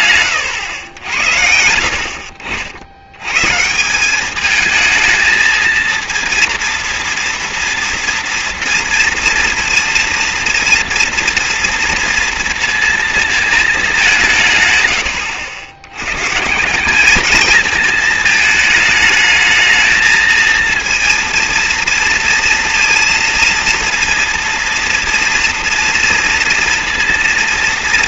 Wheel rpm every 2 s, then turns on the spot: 80, 100, 220, 230, 230, 230, 230, 90, 210, 220, 230, 230, 230, 240.
none